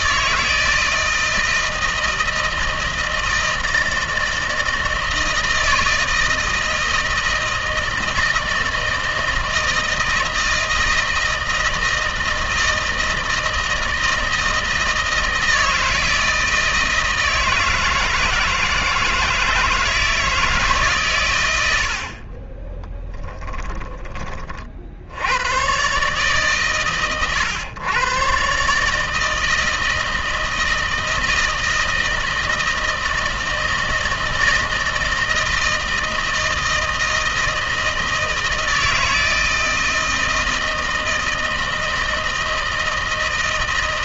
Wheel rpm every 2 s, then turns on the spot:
160, 160, 160, 160, 160, 160, 160, 160, 160, 160, 150, 30, 40, 130, 140, 160, 160, 160, 160, 160, 160, 160.
22-24